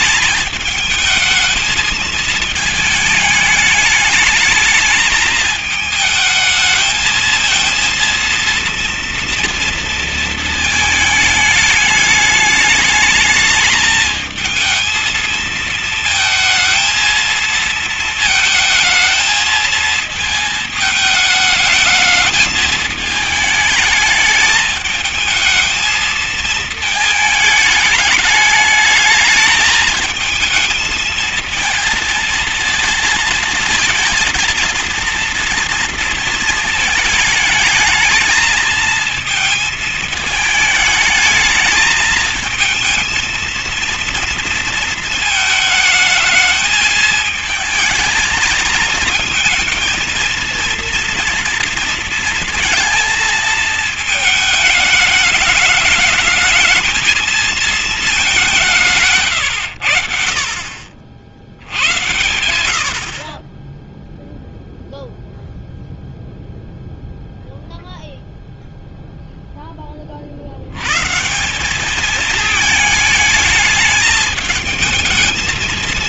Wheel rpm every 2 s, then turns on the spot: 210, 220, 210, 220, 230, 230, 210, 220, 230, 220, 220, 220, 220, 220, 210, 220, 230, 230, 220, 220, 220, 220, 230, 220, 220, 230, 230, 220, 220, 180, 50, 80, 0, 0, 0, 70, 210, 220.
none